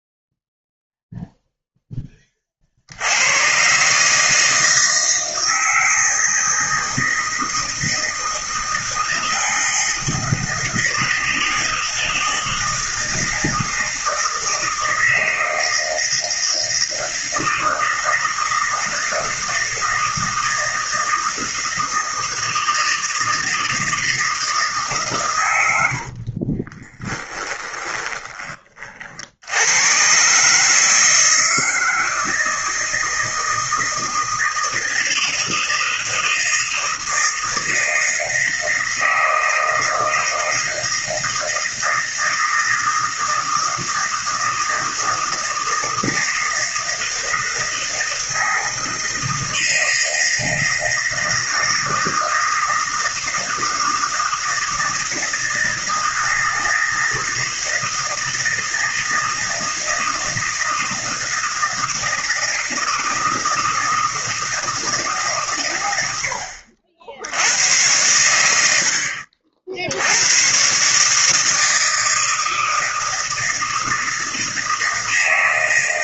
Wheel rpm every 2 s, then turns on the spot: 0, 40, 160, 160, 160, 160, 160, 160, 160, 160, 160, 160, 160, 30, 20, 140, 160, 160, 160, 160, 160, 160, 160, 160, 160, 160, 160, 160, 160, 160, 160, 160, 160, 70, 80, 110, 160, 160.
26-28